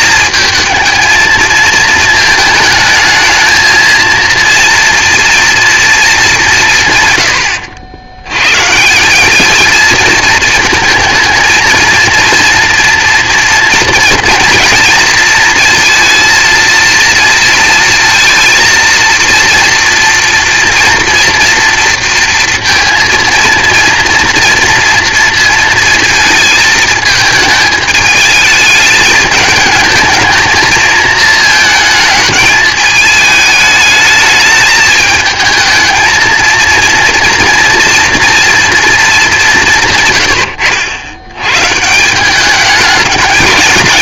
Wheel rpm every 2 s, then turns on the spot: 220, 220, 230, 160, 150, 230, 240, 230, 230, 230, 230, 230, 230, 220, 210, 230, 220, 220, 230, 230, 90, 210.
none